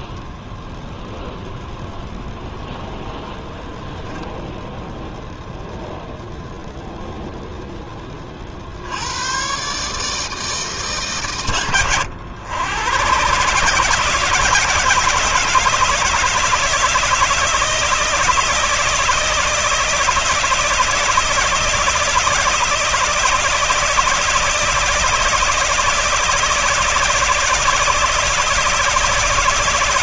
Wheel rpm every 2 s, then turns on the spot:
0, 0, 0, 0, 90, 130, 120, 160, 160, 160, 160, 160, 160, 160, 160.
none